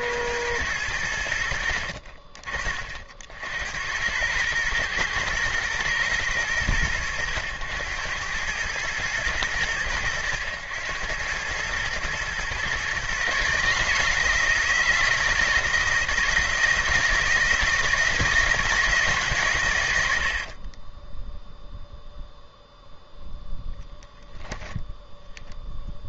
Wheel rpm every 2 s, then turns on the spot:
80, 50, 110, 100, 100, 100, 130, 160, 170, 160, 30, 0, 0.
20-22